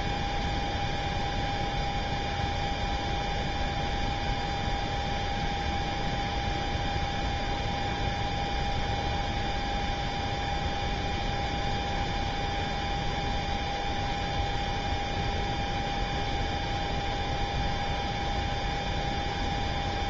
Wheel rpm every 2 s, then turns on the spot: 0, 0, 0, 0, 0, 0, 0, 0, 0, 0.
none